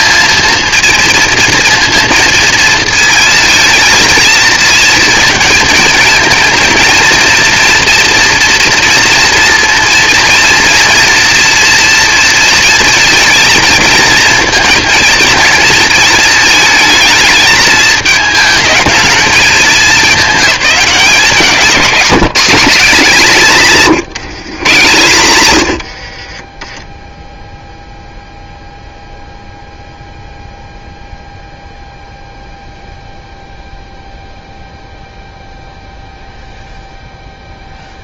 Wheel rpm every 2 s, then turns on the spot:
230, 220, 230, 230, 230, 230, 230, 230, 220, 220, 190, 200, 130, 20, 0, 0, 0, 0, 0.
26-28